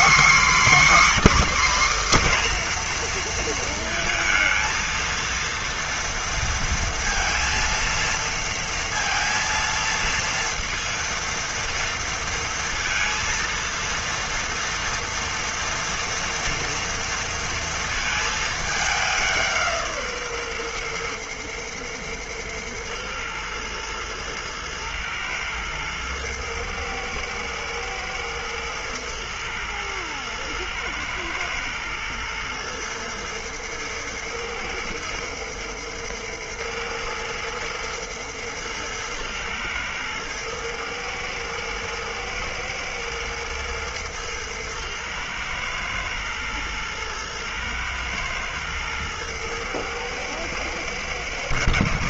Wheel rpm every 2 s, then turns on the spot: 280, 240, 230, 230, 230, 230, 230, 230, 230, 200, 120, 110, 120, 110, 110, 120, 120, 110, 110, 110, 110, 110, 110, 120, 110, 110.
none